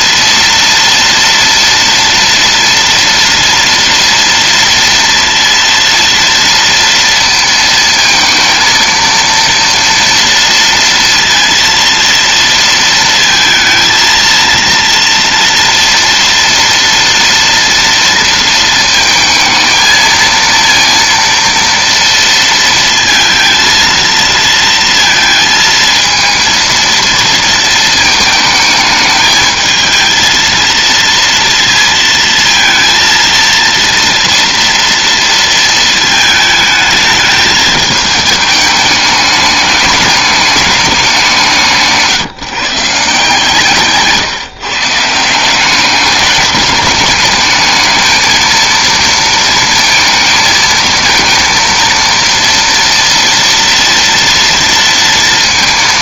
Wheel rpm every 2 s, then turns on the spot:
230, 230, 230, 230, 230, 230, 230, 230, 230, 230, 230, 230, 230, 230, 220, 230, 220, 230, 220, 210, 190, 150, 160, 210, 230, 220, 230, 230.
none